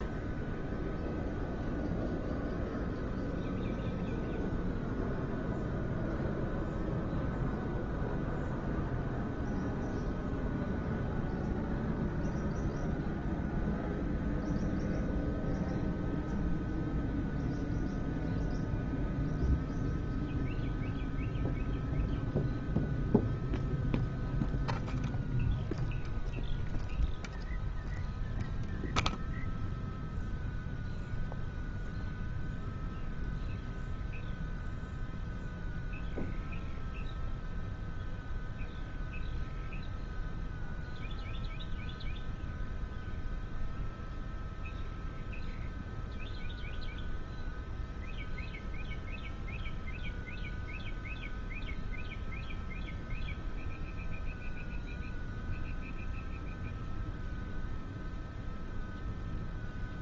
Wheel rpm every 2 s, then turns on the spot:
0, 0, 0, 0, 0, 0, 0, 0, 0, 0, 0, 0, 0, 0, 0, 0, 0, 0, 0, 0, 0, 0, 0, 0, 0, 0, 0, 0, 0, 0.
none